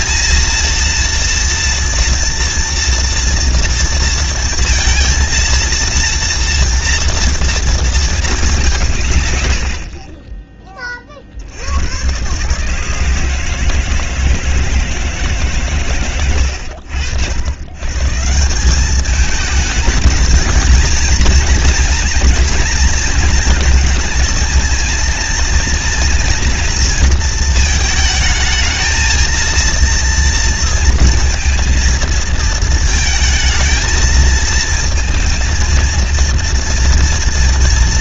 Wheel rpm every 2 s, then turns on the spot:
220, 230, 230, 230, 200, 20, 140, 160, 90, 180, 220, 240, 230, 230, 220, 230, 220, 220, 230.
none